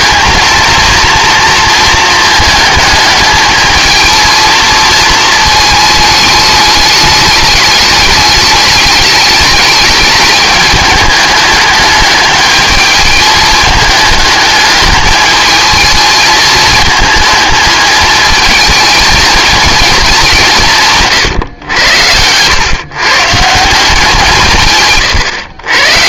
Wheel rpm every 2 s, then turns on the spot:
230, 210, 230, 210, 210, 210, 210, 220, 220, 220, 160, 130, 140.
none